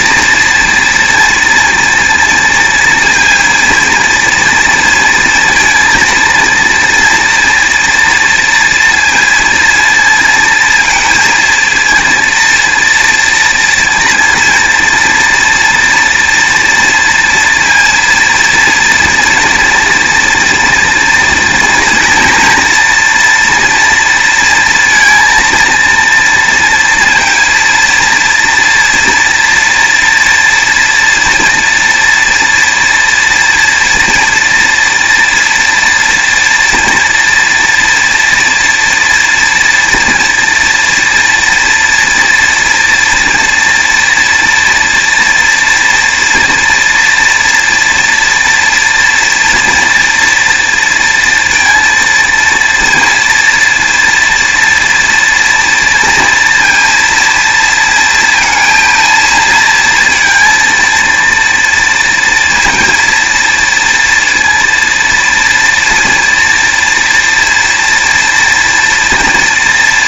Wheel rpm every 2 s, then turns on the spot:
230, 230, 230, 230, 230, 230, 230, 230, 230, 240, 230, 230, 230, 230, 230, 240, 230, 230, 240, 230, 230, 230, 230, 240, 230, 230, 230, 230, 230, 230, 230, 230, 240, 230, 230.
none